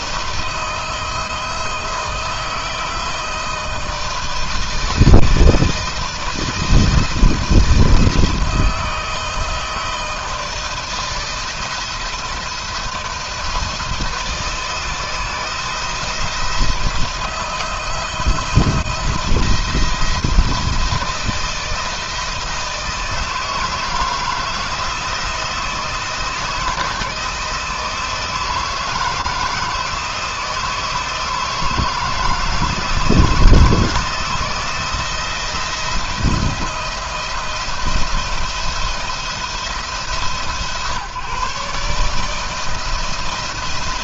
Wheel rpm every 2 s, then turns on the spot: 160, 170, 160, 170, 160, 160, 170, 160, 170, 170, 160, 160, 170, 160, 160, 160, 160, 160, 160, 170, 140, 170.
none